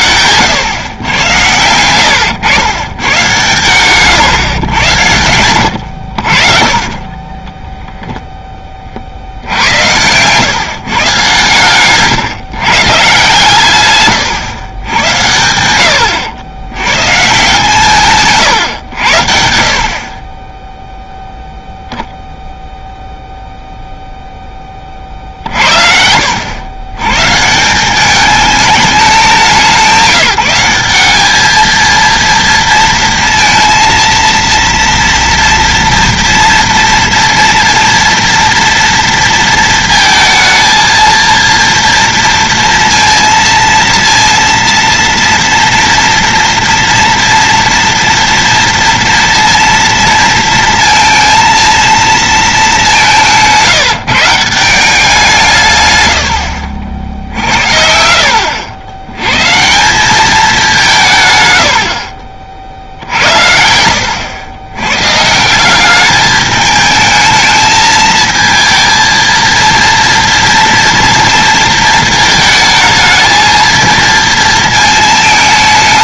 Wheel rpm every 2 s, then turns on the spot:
110, 110, 110, 30, 20, 140, 140, 100, 100, 120, 0, 0, 30, 90, 210, 180, 230, 230, 230, 230, 230, 230, 230, 230, 230, 230, 200, 170, 60, 90, 190, 50, 110, 210, 230, 240, 220, 220.
6-8